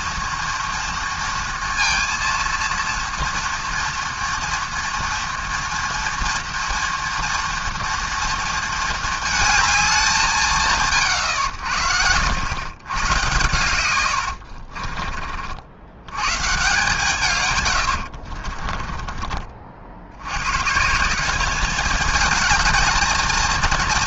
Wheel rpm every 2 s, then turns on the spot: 230, 230, 230, 230, 220, 140, 110, 40, 150, 30, 150, 220.
14-16 18-20